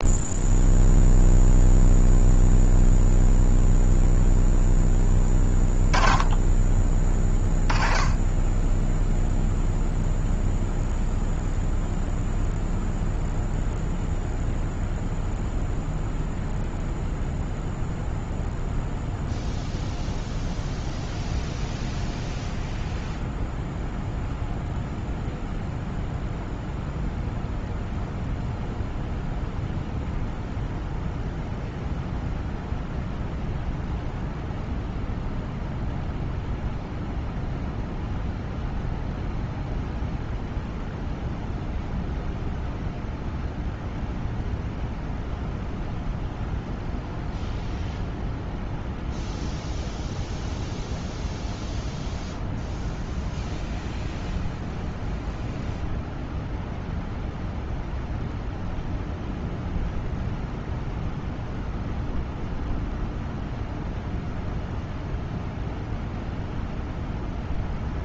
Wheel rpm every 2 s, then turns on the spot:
0, 0, 10, 20, 0, 0, 0, 0, 0, 0, 0, 0, 0, 0, 0, 0, 0, 0, 0, 0, 0, 0, 0, 0, 0, 0, 0, 0, 0, 0, 0, 0, 0, 0.
none